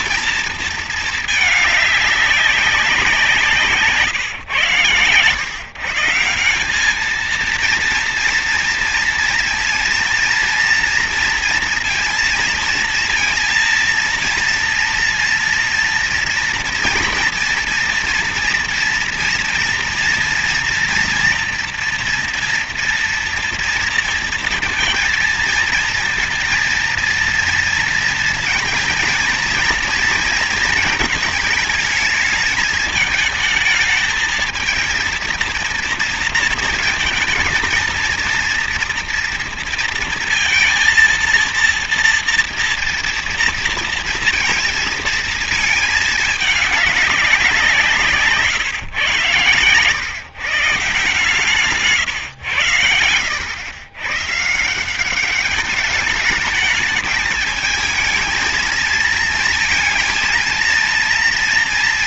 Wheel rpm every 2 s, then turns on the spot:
230, 190, 120, 190, 230, 230, 230, 230, 230, 240, 230, 230, 230, 230, 230, 230, 220, 230, 220, 230, 230, 230, 230, 210, 140, 140, 110, 160, 210, 220, 230.
none